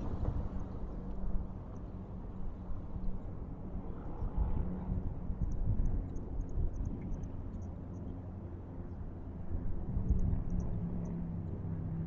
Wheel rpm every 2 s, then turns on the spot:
0, 0, 0, 0, 0, 0.
none